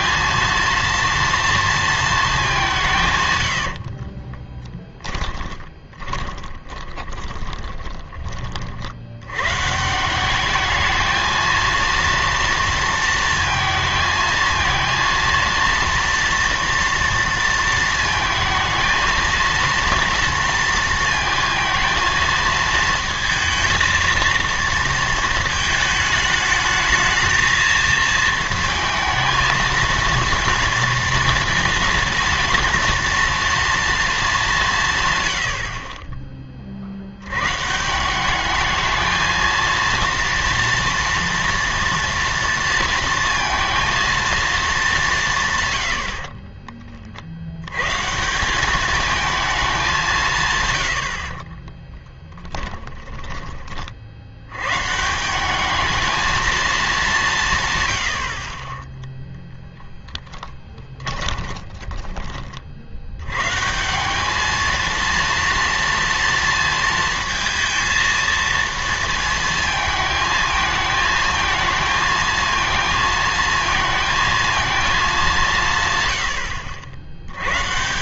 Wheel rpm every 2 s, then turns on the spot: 230, 190, 20, 20, 40, 210, 230, 230, 230, 220, 230, 220, 230, 220, 220, 230, 230, 180, 40, 210, 230, 230, 210, 20, 190, 110, 10, 120, 220, 20, 20, 50, 220, 230, 230, 220, 230, 230, 70.
4-8 52-54 60-62